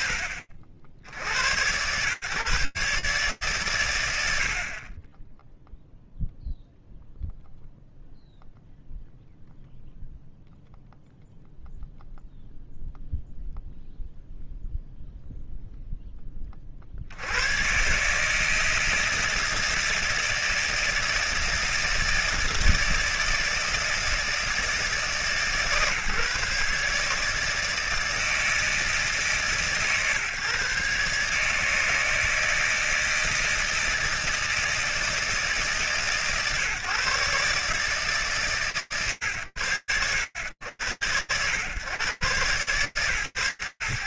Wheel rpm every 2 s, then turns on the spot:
50, 130, 20, 0, 0, 0, 0, 0, 50, 160, 160, 160, 150, 150, 150, 140, 160, 160, 140, 110, 90, 130.
none